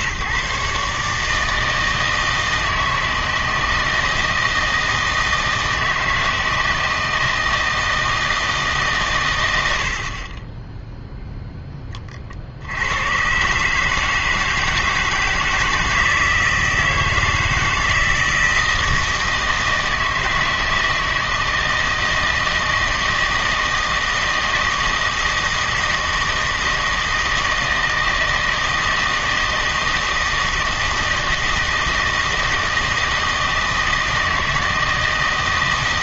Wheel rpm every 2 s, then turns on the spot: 150, 160, 160, 160, 150, 10, 90, 160, 160, 160, 160, 160, 160, 160, 160, 160, 160, 160.
none